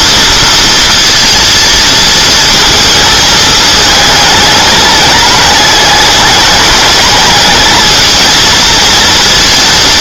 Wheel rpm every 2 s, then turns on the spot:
230, 220, 210, 210, 230.
none